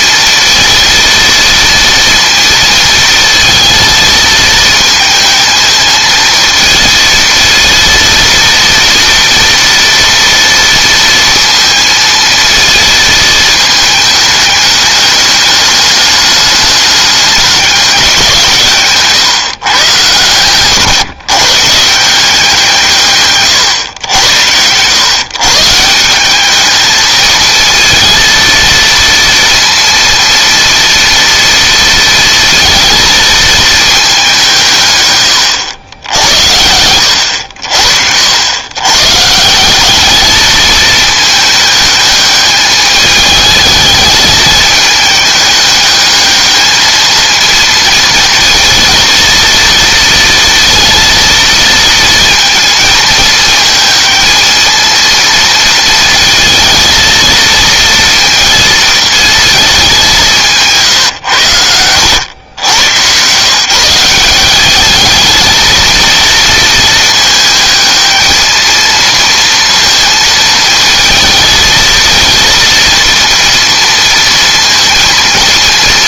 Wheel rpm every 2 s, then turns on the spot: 230, 230, 220, 230, 230, 230, 220, 210, 210, 150, 130, 170, 110, 220, 230, 230, 230, 140, 90, 120, 220, 210, 210, 220, 230, 230, 220, 220, 230, 230, 150, 110, 200, 230, 230, 220, 230, 230.
none